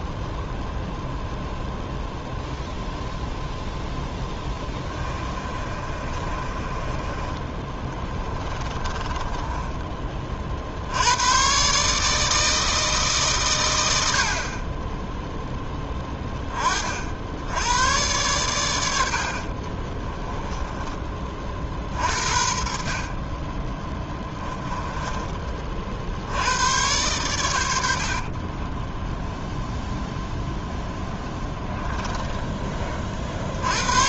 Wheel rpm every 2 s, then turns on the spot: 0, 0, 20, 20, 20, 70, 160, 20, 40, 100, 20, 50, 10, 100, 20, 0, 20.
4-10 20-22 24-26 28-30